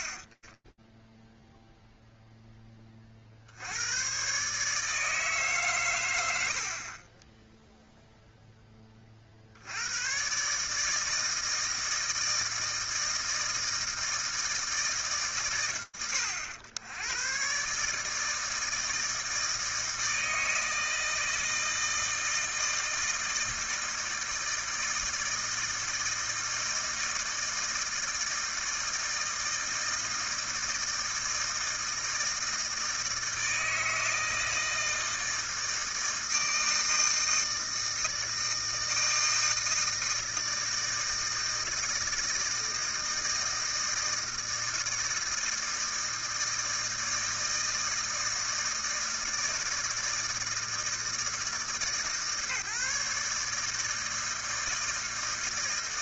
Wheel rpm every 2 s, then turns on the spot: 40, 0, 150, 50, 40, 160, 160, 150, 100, 160, 160, 160, 160, 160, 160, 160, 160, 160, 160, 160, 160, 160, 160, 160, 160, 160, 150, 160.
none